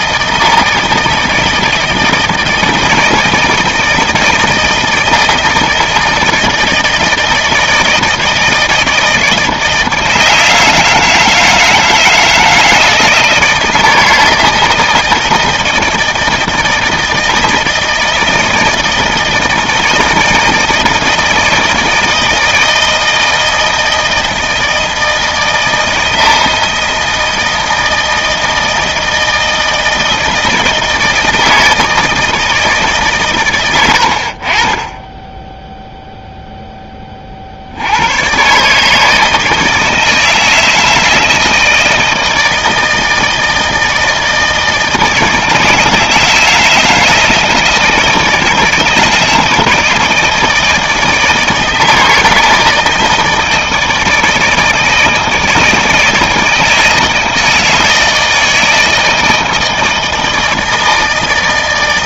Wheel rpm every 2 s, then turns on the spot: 160, 160, 160, 160, 160, 160, 160, 160, 160, 160, 160, 160, 160, 160, 160, 160, 160, 50, 0, 120, 160, 160, 160, 160, 160, 160, 160, 160, 160, 160, 160.
none